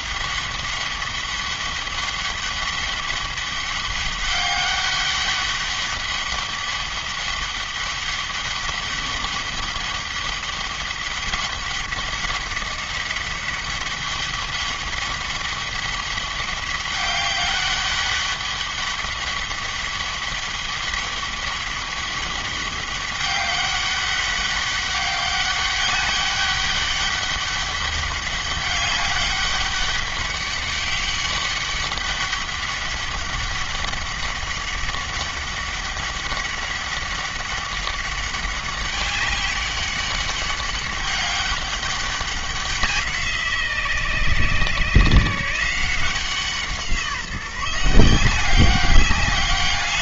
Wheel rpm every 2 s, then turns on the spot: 200, 200, 200, 200, 200, 200, 200, 200, 200, 200, 200, 200, 200, 200, 200, 200, 200, 200, 200, 200, 200, 180, 140, 170, 200.
none